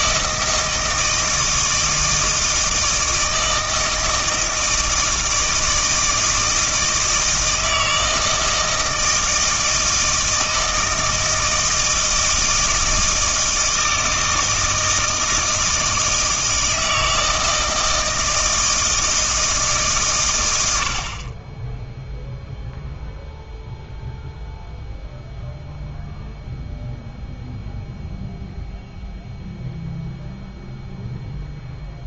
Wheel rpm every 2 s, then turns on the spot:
160, 160, 160, 160, 160, 160, 160, 160, 160, 160, 70, 0, 0, 0, 0, 0.
none